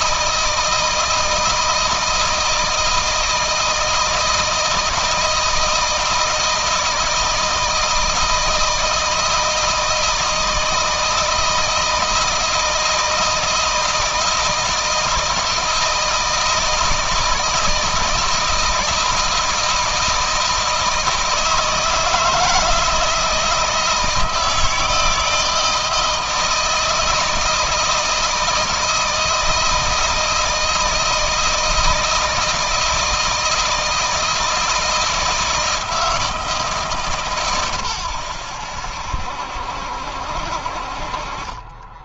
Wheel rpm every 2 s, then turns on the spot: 160, 160, 160, 170, 160, 160, 160, 160, 160, 160, 160, 160, 160, 160, 160, 160, 160, 160, 150, 80, 50.
none